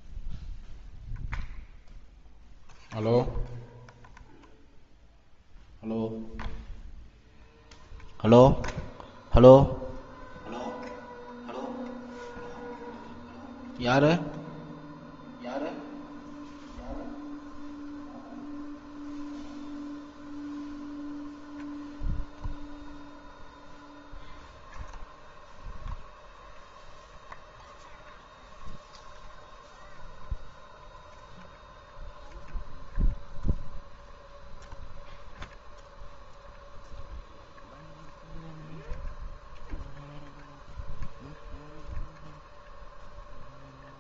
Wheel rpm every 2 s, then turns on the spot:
0, 0, 0, 0, 0, 0, 0, 0, 0, 0, 0, 0, 0, 0, 0, 0, 0, 0, 0, 0, 0, 0.
none